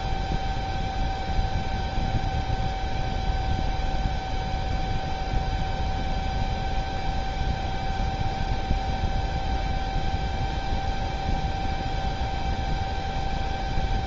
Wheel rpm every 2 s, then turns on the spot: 0, 0, 0, 0, 0, 0, 0.
none